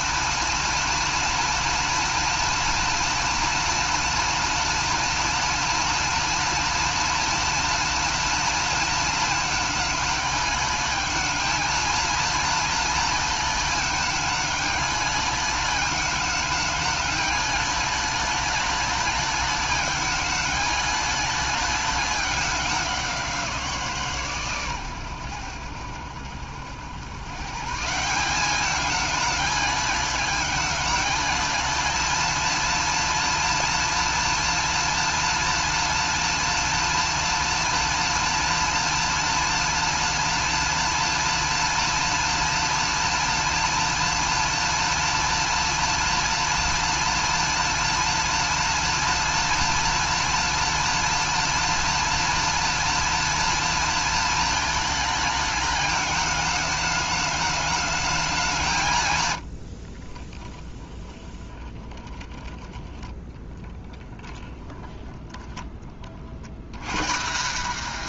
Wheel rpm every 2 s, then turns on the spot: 230, 230, 230, 230, 230, 210, 230, 210, 210, 210, 210, 190, 120, 100, 210, 210, 230, 230, 230, 230, 230, 230, 230, 230, 230, 230, 230, 220, 210, 160, 20, 10, 10, 140.
60-62